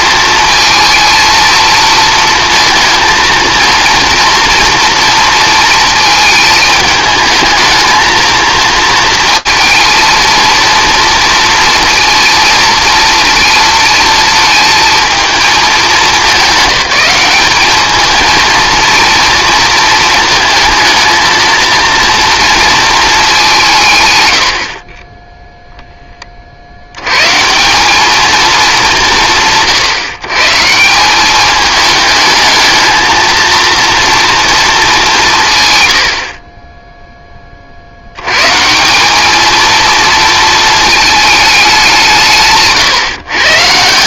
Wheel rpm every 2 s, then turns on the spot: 220, 220, 230, 220, 230, 230, 220, 220, 200, 230, 220, 230, 40, 70, 200, 160, 220, 220, 20, 170, 220, 150.
none